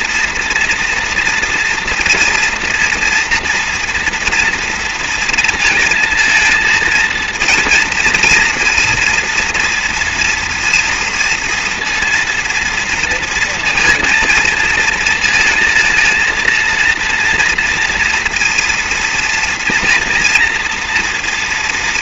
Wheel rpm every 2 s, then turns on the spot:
230, 240, 230, 220, 230, 230, 230, 230, 230, 230, 230.
none